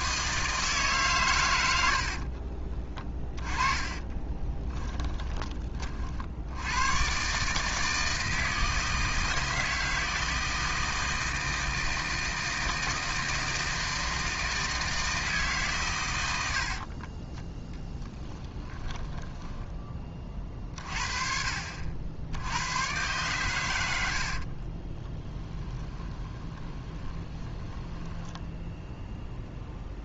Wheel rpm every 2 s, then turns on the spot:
140, 20, 10, 120, 160, 160, 160, 160, 40, 20, 40, 110, 30, 20, 0.
2-4 16-20 24-28